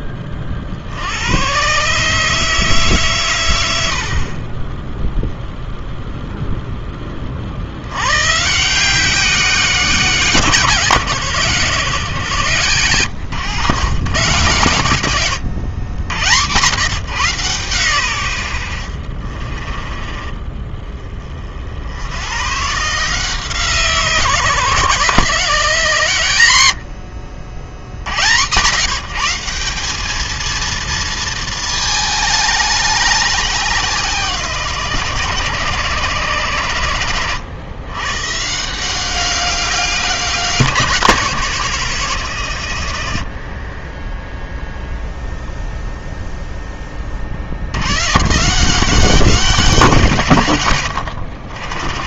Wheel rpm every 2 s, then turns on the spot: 50, 140, 10, 10, 160, 140, 130, 120, 140, 70, 20, 150, 140, 80, 150, 230, 210, 150, 110, 170, 180, 90, 0, 20, 180, 100.
26-28